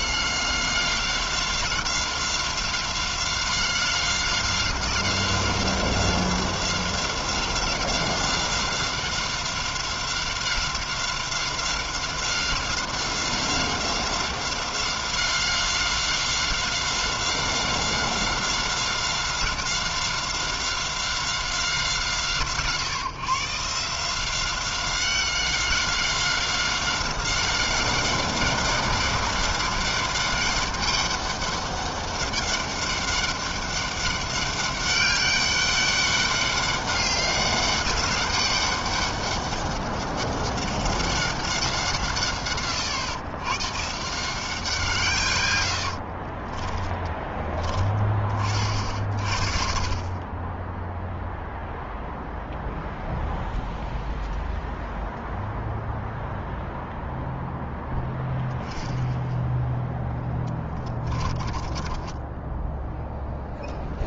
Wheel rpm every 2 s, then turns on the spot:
180, 180, 190, 190, 190, 190, 190, 190, 190, 190, 190, 150, 190, 190, 200, 200, 200, 200, 200, 200, 190, 120, 120, 10, 40, 0, 0, 0, 0, 0, 20, 10.
60-64